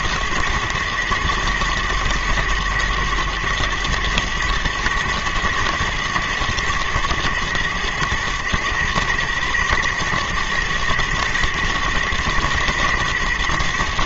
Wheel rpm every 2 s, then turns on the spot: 120, 110, 110, 110, 120, 110, 110.
none